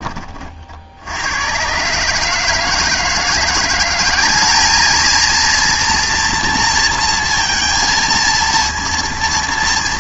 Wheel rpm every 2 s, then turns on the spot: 50, 150, 210, 230, 230.
none